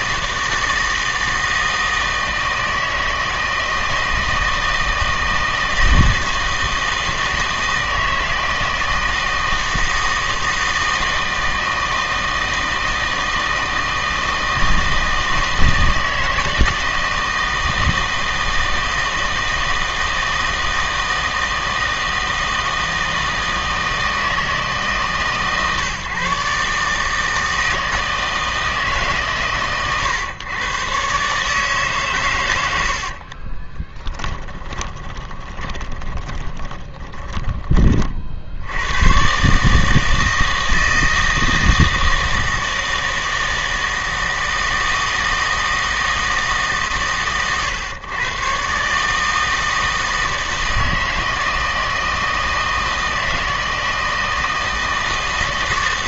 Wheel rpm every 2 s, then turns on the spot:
160, 160, 160, 160, 160, 160, 160, 160, 160, 160, 160, 160, 150, 150, 160, 130, 90, 20, 10, 80, 160, 160, 160, 140, 130, 160, 160, 160.
34-38